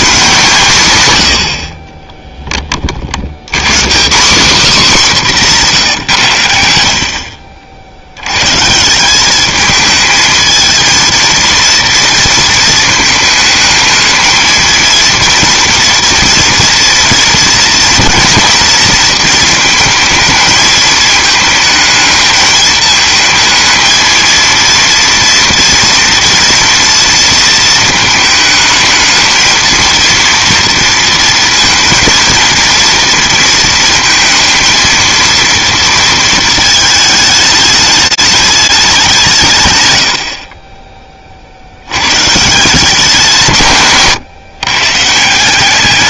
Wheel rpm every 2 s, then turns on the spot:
180, 20, 240, 90, 140, 220, 220, 230, 230, 230, 220, 220, 230, 230, 220, 230, 230, 230, 220, 200, 30, 150, 130.
none